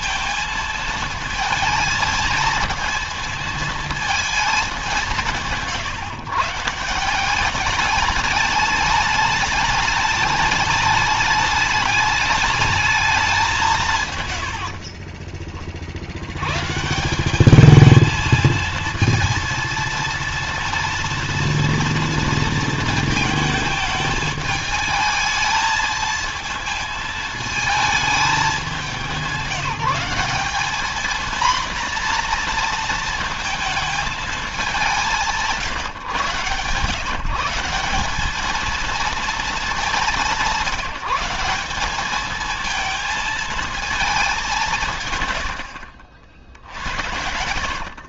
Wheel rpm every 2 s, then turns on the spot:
220, 220, 190, 160, 210, 210, 210, 60, 130, 230, 230, 230, 220, 220, 200, 210, 230, 200, 130, 220, 180, 220, 170, 80.
14-16